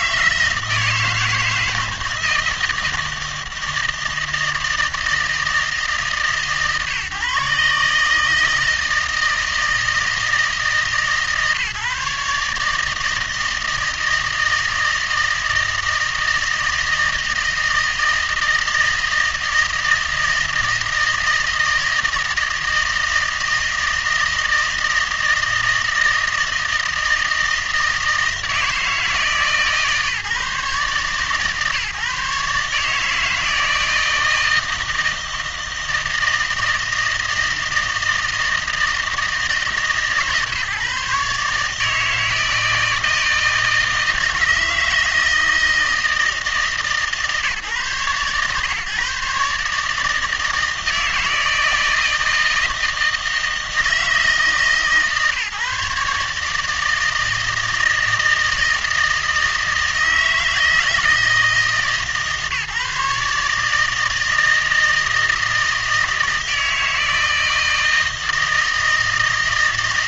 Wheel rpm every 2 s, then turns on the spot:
160, 160, 160, 140, 160, 150, 160, 160, 160, 160, 160, 160, 160, 160, 160, 140, 150, 160, 160, 160, 140, 160, 160, 160, 140, 160, 160, 160, 160, 160, 160, 150, 160, 160, 160.
none